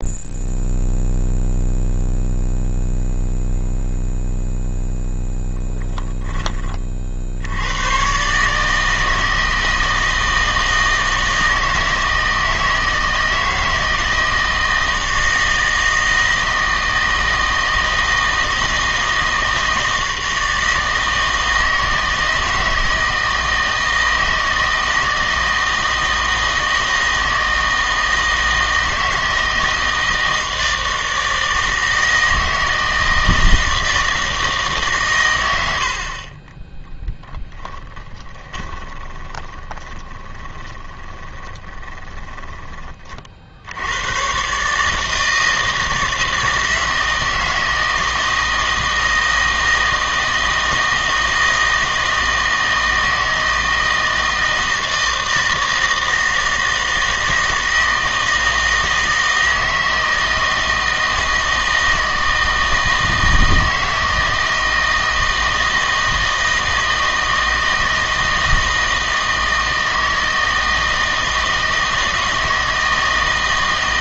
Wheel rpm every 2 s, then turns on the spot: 0, 0, 0, 20, 150, 160, 160, 160, 160, 160, 160, 160, 160, 160, 160, 160, 160, 150, 20, 20, 20, 20, 140, 160, 160, 160, 160, 160, 160, 160, 160, 160, 160, 160, 160, 160, 160.
38-42